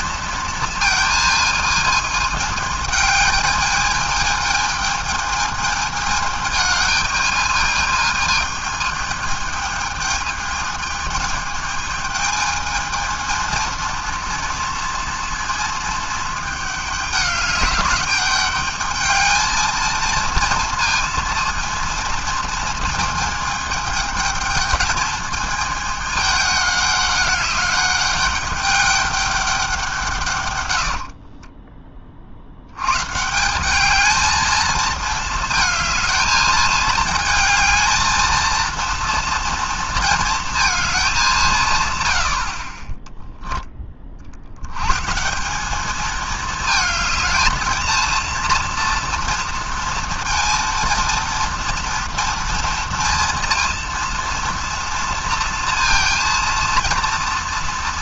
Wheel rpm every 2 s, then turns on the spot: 230, 220, 220, 220, 220, 220, 220, 230, 210, 210, 230, 220, 220, 200, 200, 90, 100, 220, 220, 230, 220, 30, 110, 220, 230, 230, 230, 230, 230.
30-32